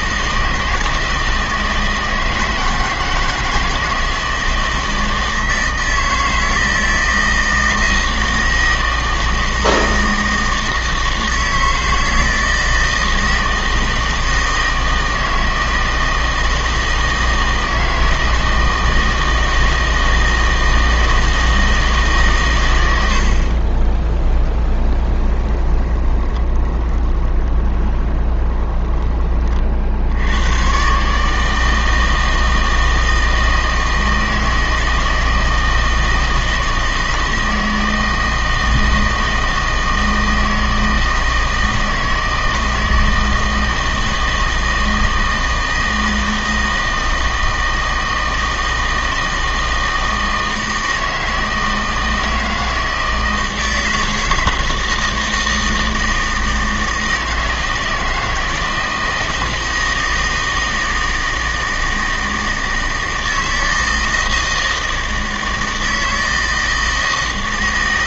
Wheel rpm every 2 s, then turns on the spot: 160, 160, 160, 160, 160, 160, 160, 160, 160, 160, 160, 110, 10, 20, 20, 120, 160, 160, 160, 160, 160, 160, 160, 160, 160, 160, 160, 160, 160, 160, 160, 160, 160, 160.
24-30